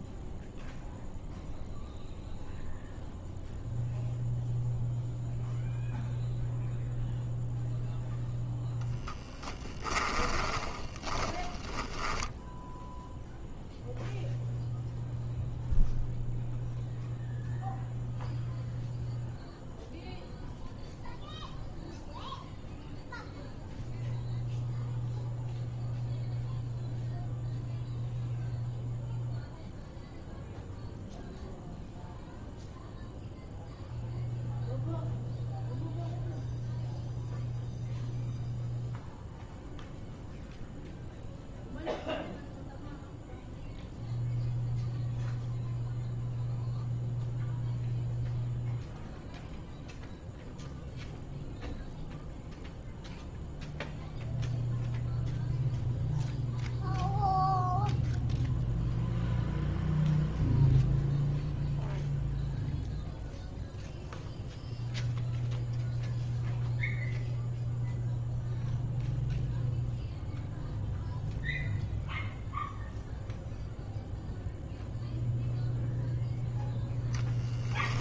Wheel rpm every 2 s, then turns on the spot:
0, 0, 0, 0, 0, 20, 10, 0, 0, 0, 0, 0, 0, 0, 0, 0, 0, 0, 0, 0, 0, 0, 0, 0, 0, 0, 0, 0, 0, 0, 0, 0, 0, 0, 0, 0, 0, 0, 0.
10-14